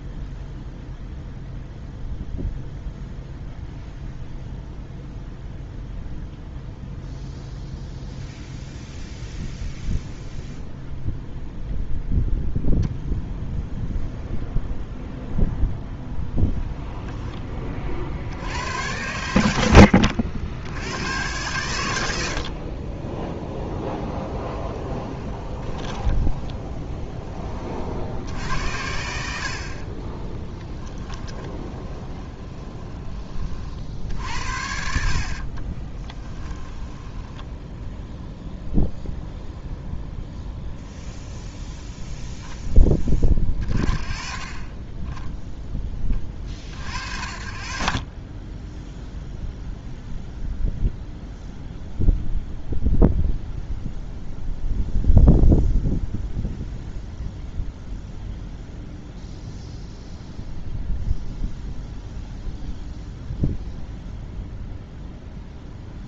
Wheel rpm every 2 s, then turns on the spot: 0, 0, 0, 0, 0, 0, 0, 0, 10, 100, 100, 30, 0, 10, 80, 20, 10, 60, 10, 0, 0, 10, 20, 40, 10, 0, 0, 0, 0, 0, 0, 0, 0.
16-18 30-32 36-38